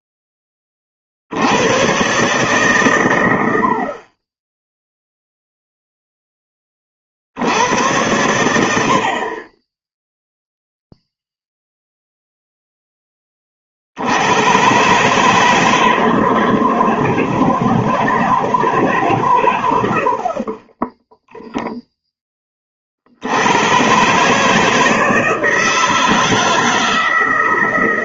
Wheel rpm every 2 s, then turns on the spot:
20, 140, 10, 20, 90, 0, 0, 120, 160, 160, 30, 20, 150, 160.
none